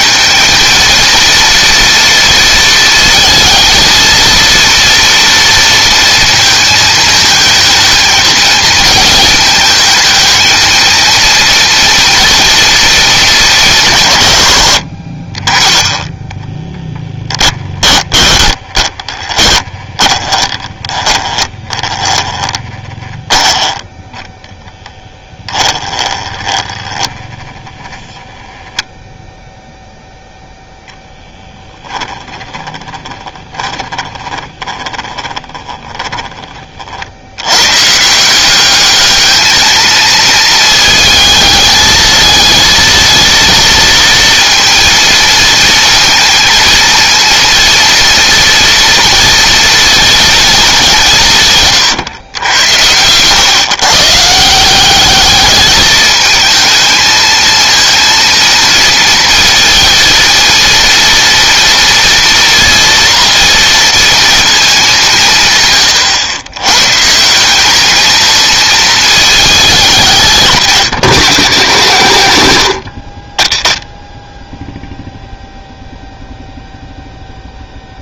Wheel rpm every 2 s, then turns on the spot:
230, 230, 230, 220, 220, 220, 220, 70, 10, 20, 20, 20, 10, 10, 0, 0, 20, 20, 50, 200, 220, 220, 230, 230, 230, 190, 110, 190, 220, 230, 230, 230, 190, 140, 220, 170, 80, 0, 0.
16-24 26-28 32-36